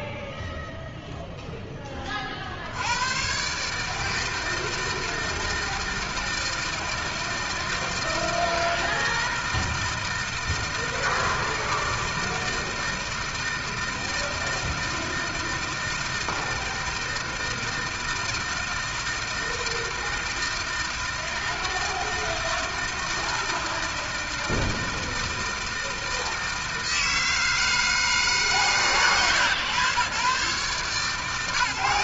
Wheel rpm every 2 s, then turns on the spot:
70, 160, 160, 160, 160, 160, 160, 160, 160, 160, 160, 160, 160, 160, 120, 140.
none